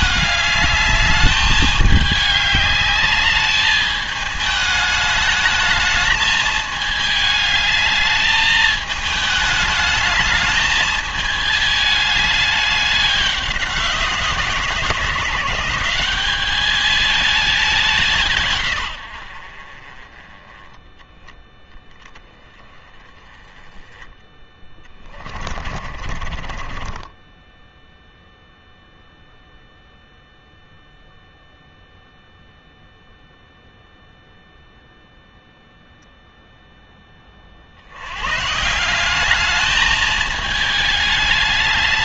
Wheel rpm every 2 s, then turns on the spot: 210, 200, 210, 220, 210, 220, 200, 170, 210, 100, 10, 20, 20, 20, 0, 0, 0, 0, 10, 190, 210.
24-28